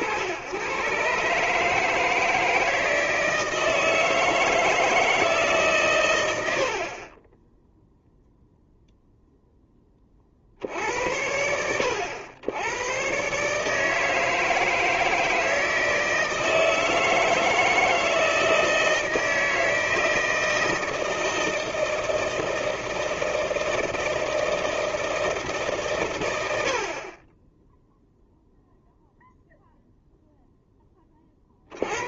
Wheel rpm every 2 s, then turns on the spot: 90, 160, 160, 60, 0, 60, 100, 160, 160, 160, 160, 160, 160, 60, 0, 10.
none